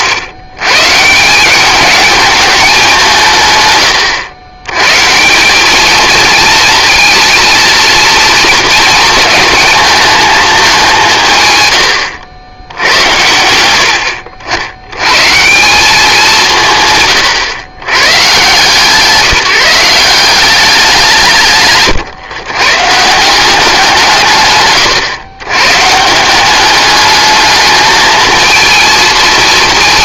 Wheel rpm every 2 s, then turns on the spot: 130, 200, 120, 230, 230, 190, 90, 80, 150, 150, 190, 130, 120, 200, 230.
none